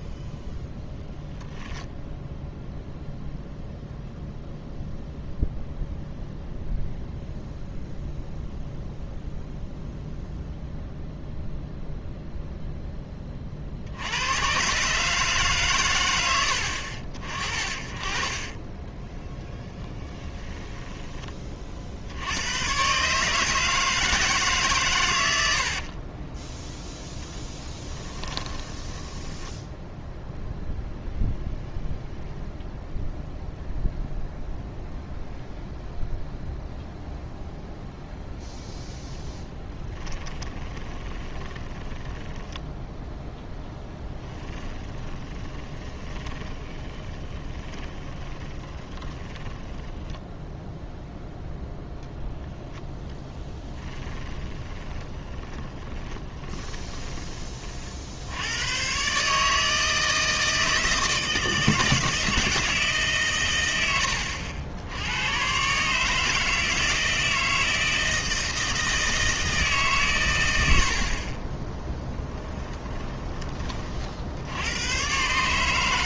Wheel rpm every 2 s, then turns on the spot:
10, 0, 0, 0, 0, 0, 0, 130, 70, 10, 10, 120, 140, 10, 10, 0, 0, 0, 0, 0, 20, 10, 10, 20, 20, 0, 0, 30, 20, 110, 160, 160, 80, 160, 160, 80, 20, 100.
0-2 18-22 26-30 40-50 54-58 72-74